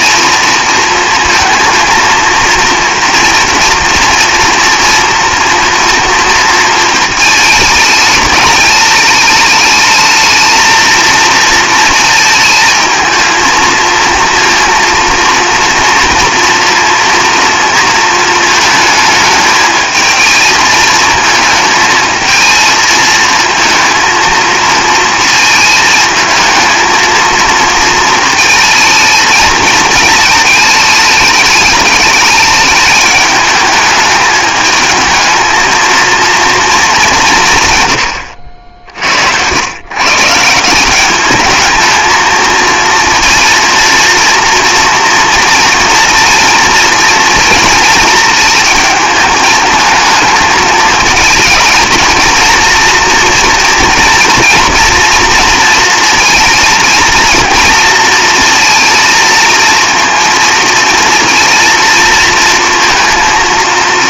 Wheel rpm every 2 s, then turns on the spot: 230, 230, 240, 230, 210, 220, 230, 230, 230, 220, 220, 220, 220, 220, 220, 220, 210, 210, 220, 70, 170, 230, 240, 230, 220, 220, 230, 230, 230, 230, 230, 230.
none